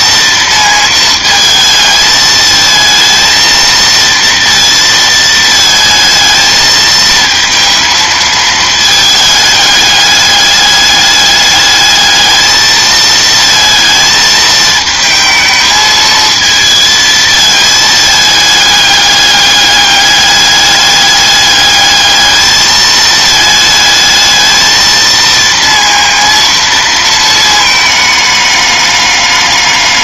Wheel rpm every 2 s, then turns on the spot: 230, 220, 230, 220, 220, 210, 220, 220, 220, 210, 210, 220, 220, 230, 210.
none